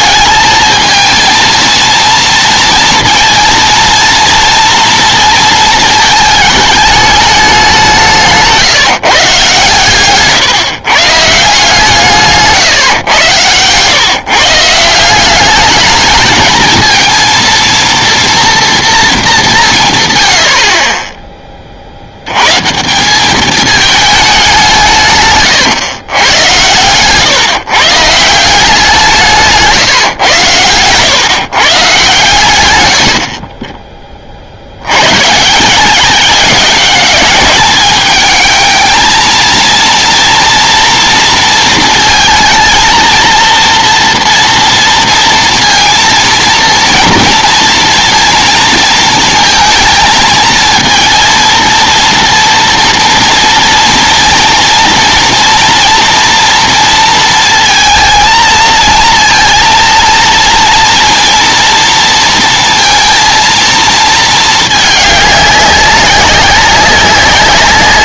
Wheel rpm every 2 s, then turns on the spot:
220, 230, 230, 210, 150, 130, 130, 160, 230, 230, 40, 160, 160, 120, 180, 110, 90, 80, 200, 220, 240, 220, 230, 230, 230, 230, 230, 230, 230, 230, 230, 230, 210, 190.
26-28